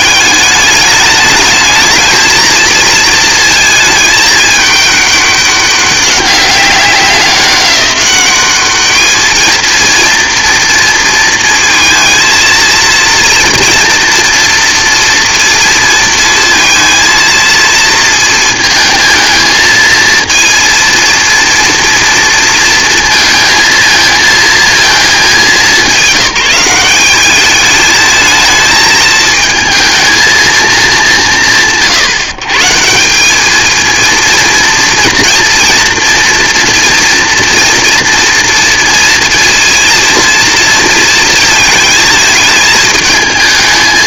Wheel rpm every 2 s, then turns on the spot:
210, 230, 210, 200, 200, 240, 230, 230, 230, 230, 230, 230, 230, 190, 220, 220, 170, 230, 230, 230, 230, 220.
none